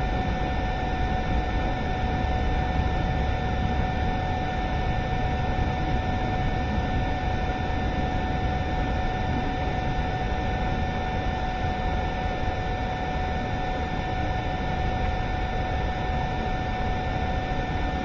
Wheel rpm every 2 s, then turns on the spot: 0, 0, 0, 0, 0, 0, 0, 0, 0.
none